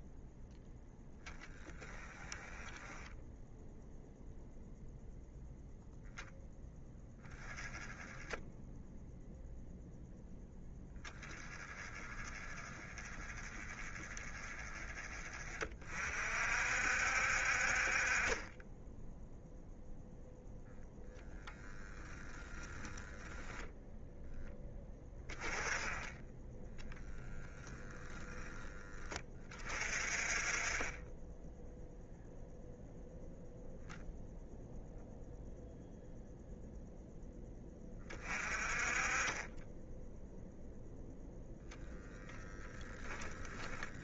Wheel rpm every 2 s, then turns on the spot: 10, 10, 0, 10, 0, 10, 20, 30, 60, 10, 0, 10, 10, 0, 20, 20, 0, 0, 0, 30, 0, 20.
42-44